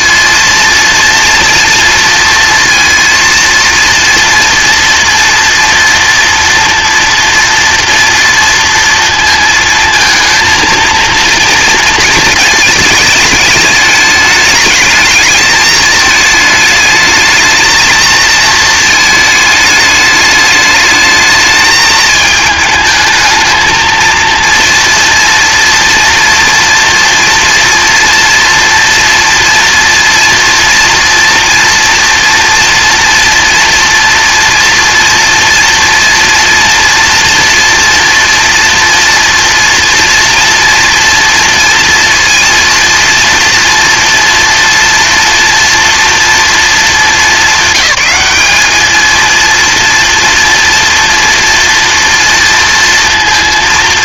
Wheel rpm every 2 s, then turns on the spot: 230, 230, 230, 230, 230, 230, 220, 220, 210, 220, 210, 210, 230, 230, 230, 230, 240, 230, 230, 230, 240, 230, 230, 230, 210, 230, 230.
none